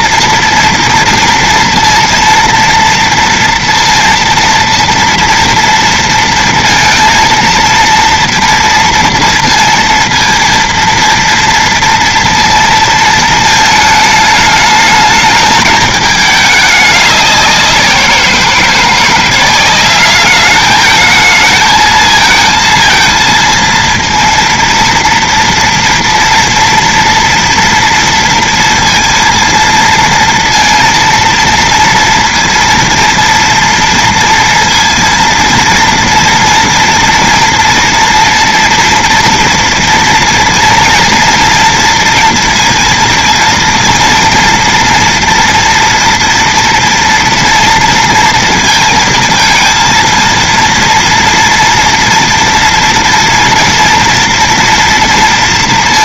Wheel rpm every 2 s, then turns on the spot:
230, 230, 230, 230, 230, 230, 230, 210, 210, 170, 200, 220, 230, 230, 230, 230, 230, 230, 230, 240, 230, 230, 230, 230, 230, 230, 230, 240.
none